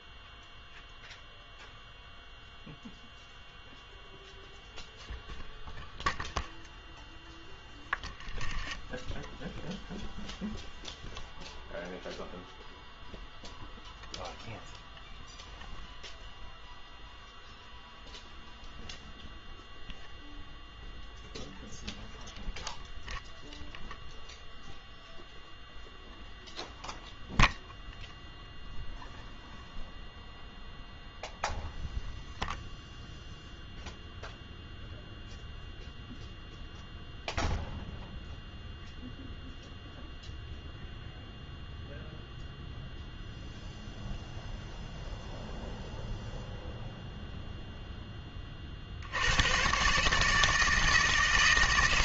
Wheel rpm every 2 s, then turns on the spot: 0, 0, 0, 0, 10, 0, 0, 0, 0, 0, 0, 0, 0, 0, 0, 0, 0, 0, 0, 0, 0, 0, 0, 0, 30, 160.
none